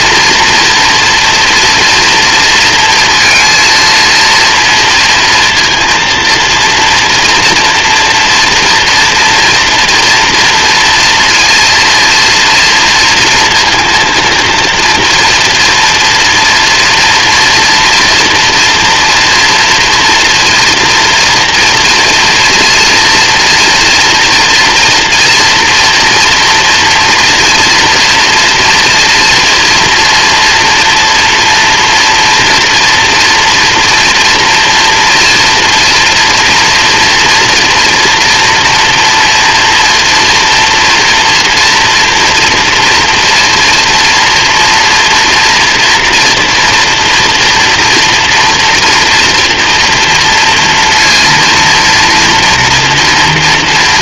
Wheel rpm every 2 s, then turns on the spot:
240, 230, 230, 230, 240, 230, 230, 230, 240, 230, 230, 230, 230, 230, 230, 230, 240, 230, 230, 230, 230, 230, 230, 240, 240, 240, 230.
none